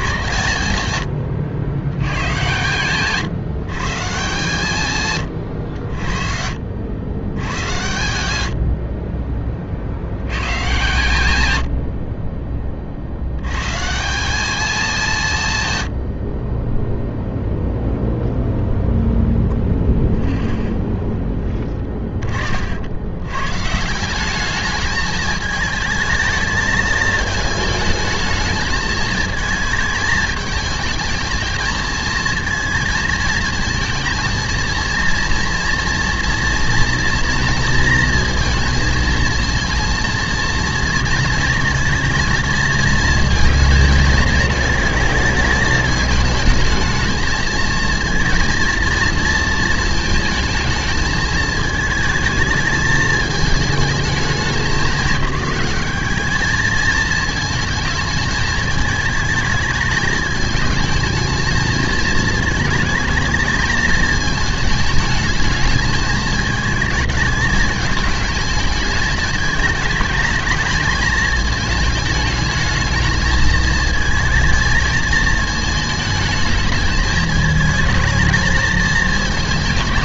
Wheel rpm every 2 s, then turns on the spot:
160, 130, 120, 60, 80, 130, 30, 210, 30, 0, 0, 50, 210, 220, 220, 220, 230, 230, 230, 230, 230, 230, 220, 220, 230, 220, 220, 190, 220, 220, 220, 220, 220, 220, 220, 220, 220, 220, 220, 220.
none